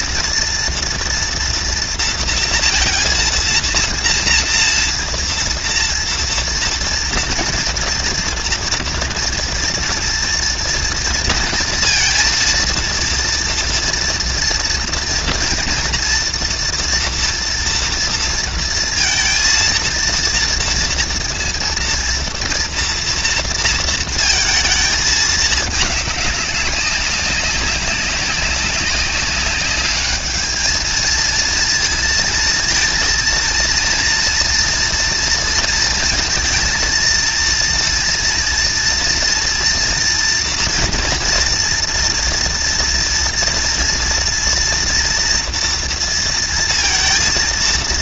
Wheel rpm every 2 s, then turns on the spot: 230, 230, 230, 230, 230, 230, 230, 230, 240, 230, 230, 230, 230, 200, 200, 220, 230, 230, 230, 230, 230, 230, 230, 230.
none